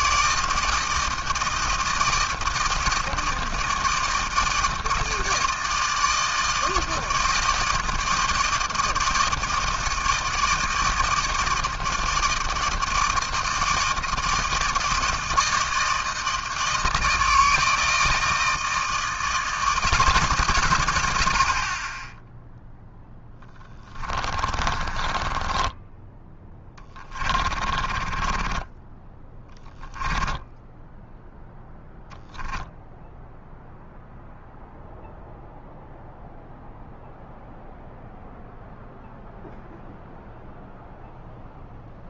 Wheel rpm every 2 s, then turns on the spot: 160, 160, 160, 160, 160, 160, 160, 160, 160, 160, 70, 10, 20, 30, 20, 0, 0, 0, 0, 0, 0.
22-30